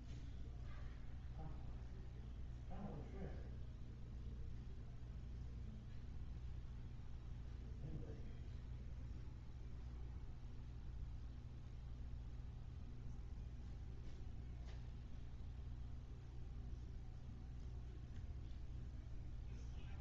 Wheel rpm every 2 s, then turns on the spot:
0, 0, 0, 0, 0, 0, 0, 0, 0, 0.
none